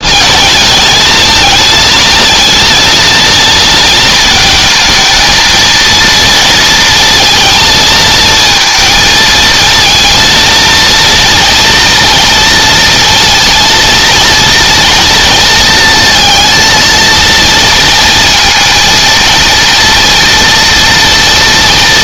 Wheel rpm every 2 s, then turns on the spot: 220, 230, 230, 230, 230, 230, 230, 230, 230, 230, 230.
none